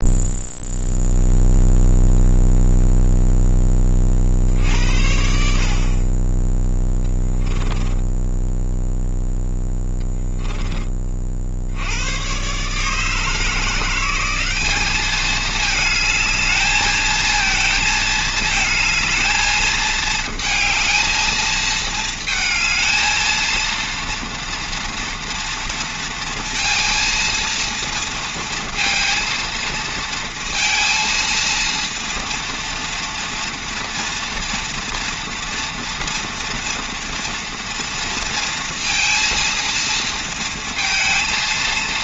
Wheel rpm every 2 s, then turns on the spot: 0, 0, 70, 10, 0, 30, 140, 200, 220, 220, 220, 230, 230, 230, 230, 230, 230, 230, 230, 230, 230.
6-8